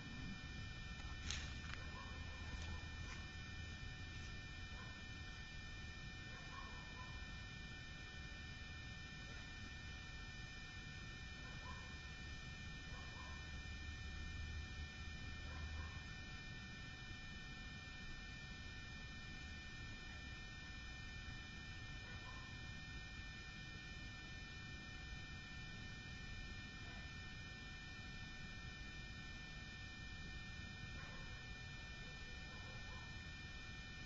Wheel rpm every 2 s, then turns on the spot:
0, 0, 0, 0, 0, 0, 0, 0, 0, 0, 0, 0, 0, 0, 0, 0, 0.
none